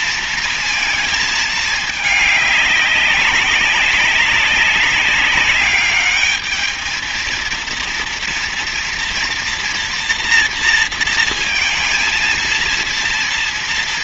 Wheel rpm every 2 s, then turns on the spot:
230, 210, 200, 220, 230, 230, 230.
none